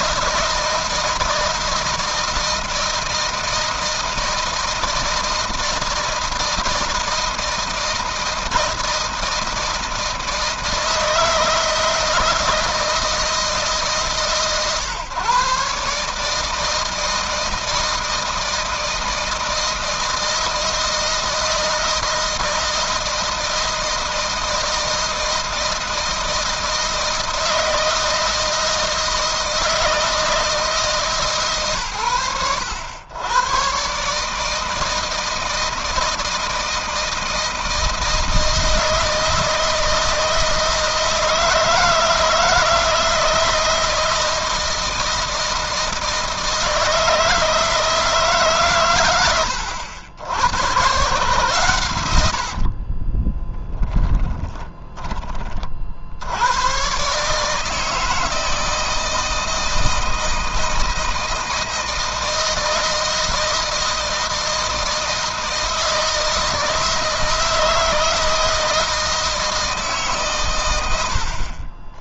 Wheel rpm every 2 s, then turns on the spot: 160, 160, 160, 160, 160, 160, 160, 130, 160, 160, 160, 160, 160, 160, 160, 160, 100, 160, 160, 160, 160, 160, 160, 160, 120, 120, 50, 20, 110, 160, 160, 160, 160, 160, 160, 110.
52-56